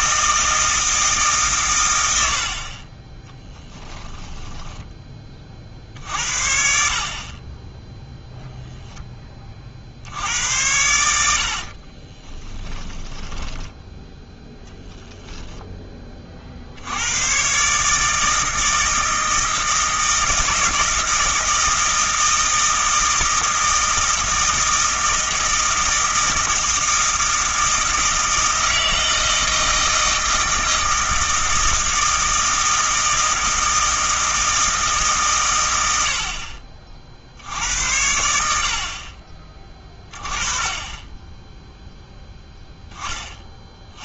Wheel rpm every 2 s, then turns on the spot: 160, 40, 20, 60, 0, 90, 20, 0, 60, 160, 160, 160, 160, 160, 160, 160, 160, 150, 40, 70, 20, 0.
4-6 12-14